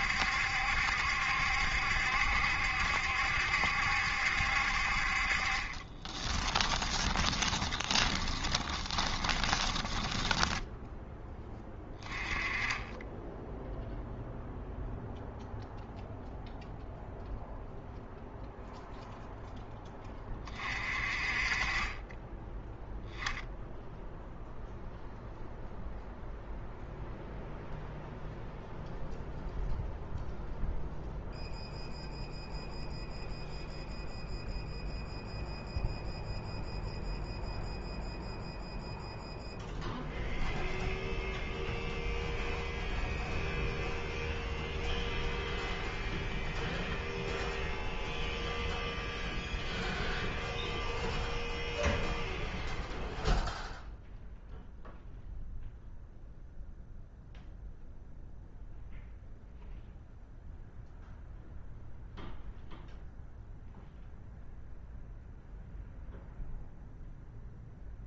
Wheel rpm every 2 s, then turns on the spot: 70, 70, 50, 20, 20, 10, 20, 0, 0, 0, 40, 0, 0, 0, 0, 0, 0, 0, 0, 0, 0, 0, 0, 0, 0, 0, 0, 0, 0, 0, 0, 0, 0, 0.
6-10